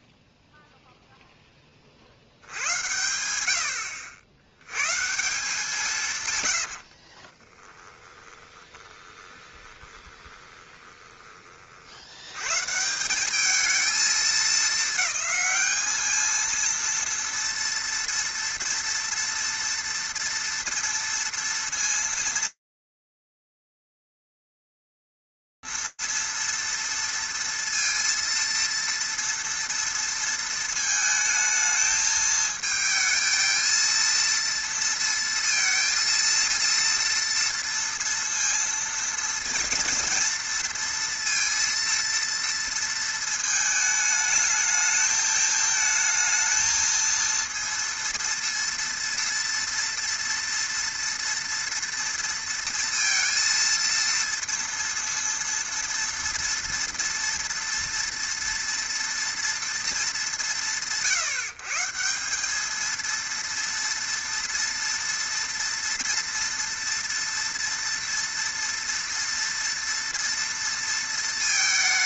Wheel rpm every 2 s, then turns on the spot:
0, 80, 150, 20, 20, 20, 190, 210, 230, 230, 230, 230, 230, 230, 220, 230, 230, 230, 230, 230, 220, 220, 230, 230, 230, 230, 230, 240, 230, 150, 230, 230, 230, 230, 220, 210.
6-10